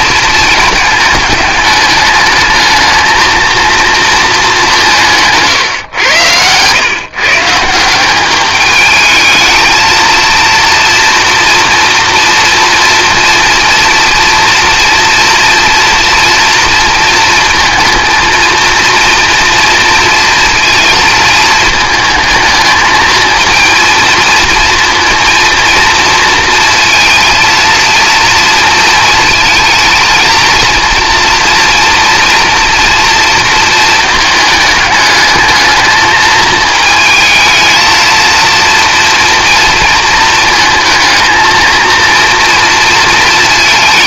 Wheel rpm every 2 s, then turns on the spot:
220, 220, 180, 120, 210, 230, 230, 230, 230, 230, 230, 220, 230, 230, 230, 230, 230, 210, 220, 230, 220, 230.
none